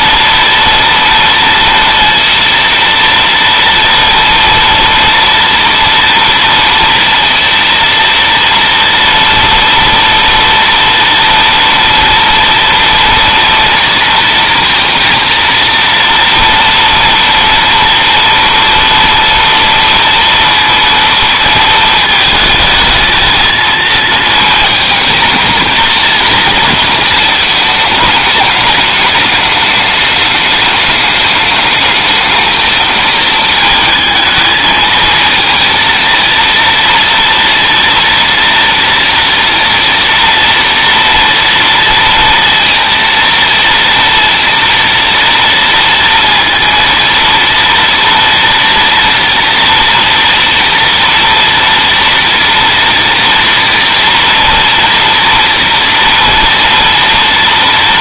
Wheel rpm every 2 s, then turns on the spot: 230, 230, 230, 230, 230, 230, 230, 230, 230, 230, 230, 220, 220, 220, 210, 210, 220, 220, 230, 230, 230, 230, 230, 230, 230, 230, 230, 230, 230.
none